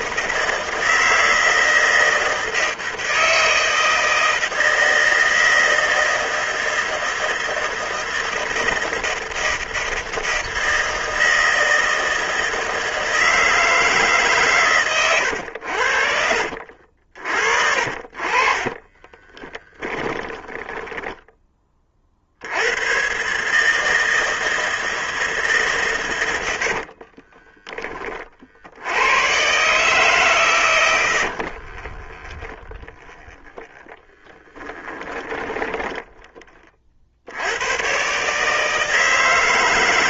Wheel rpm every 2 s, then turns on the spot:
160, 160, 160, 160, 160, 160, 160, 120, 60, 20, 10, 110, 160, 50, 90, 120, 20, 10, 40, 150.
14-16 18-22 26-28 30-36